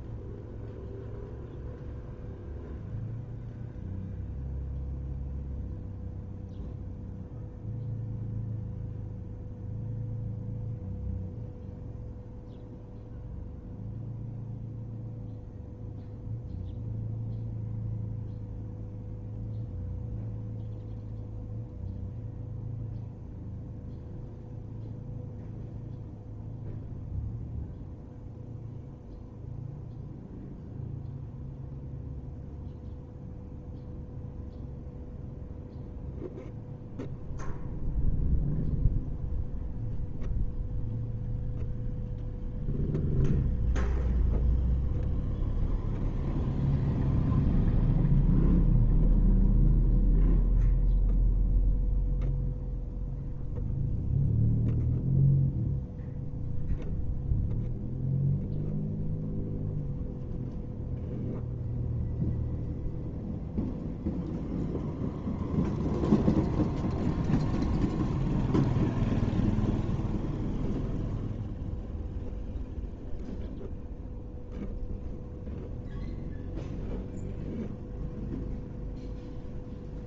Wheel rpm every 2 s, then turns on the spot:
0, 0, 0, 0, 0, 0, 0, 0, 0, 0, 0, 0, 0, 0, 0, 0, 0, 0, 0, 0, 0, 0, 0, 0, 0, 0, 0, 0, 0, 0, 0, 0, 0, 0, 0, 0, 0, 0, 0, 0.
none